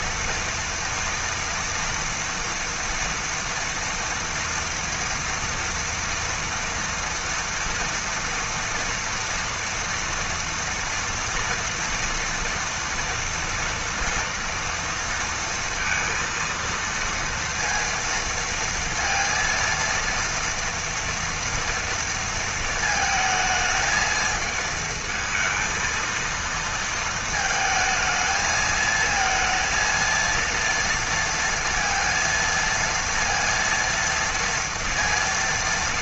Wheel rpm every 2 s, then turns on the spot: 230, 230, 230, 230, 230, 230, 240, 230, 230, 230, 230, 230, 220, 230, 220, 230, 230, 230.
none